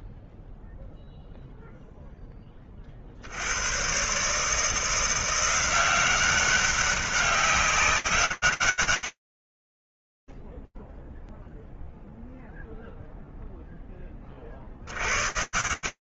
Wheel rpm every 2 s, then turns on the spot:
0, 50, 170, 200, 70, 0, 0, 70.
none